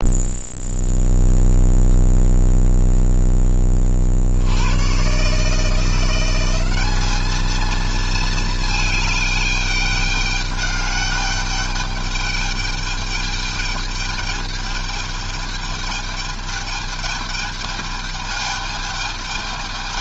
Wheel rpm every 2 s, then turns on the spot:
0, 0, 80, 190, 220, 200, 210, 210, 210, 210.
none